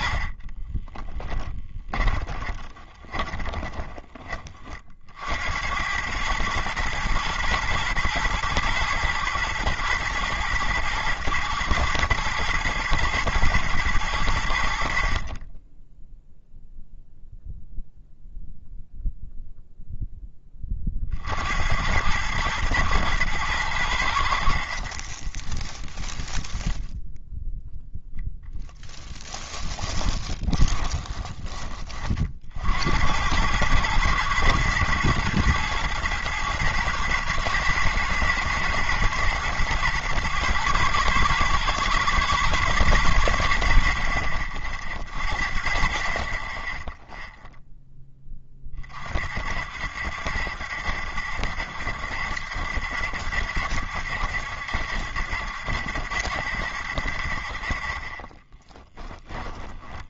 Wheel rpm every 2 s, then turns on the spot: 30, 20, 30, 110, 120, 120, 120, 80, 0, 0, 20, 110, 60, 10, 20, 20, 60, 110, 110, 120, 120, 120, 50, 20, 30, 70, 70, 70, 70, 20.
0-4 24-32 58-60